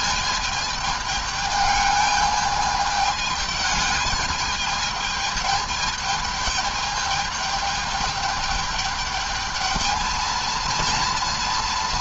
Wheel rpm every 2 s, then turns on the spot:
220, 210, 220, 220, 210, 230.
none